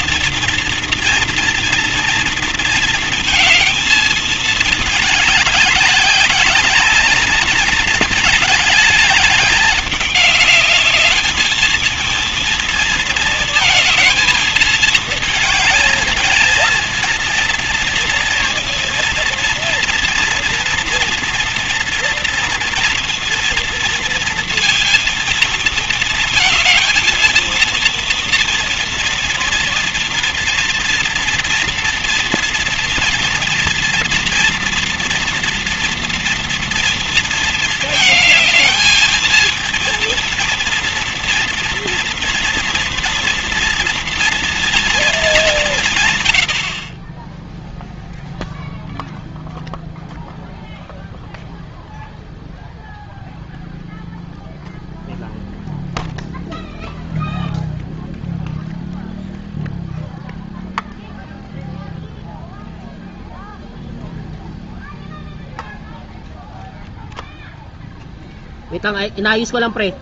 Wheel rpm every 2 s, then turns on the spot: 230, 230, 210, 200, 210, 210, 230, 220, 220, 230, 230, 230, 230, 220, 230, 230, 240, 230, 230, 220, 230, 240, 230, 60, 0, 0, 0, 0, 0, 0, 0, 0, 0, 0, 0.
none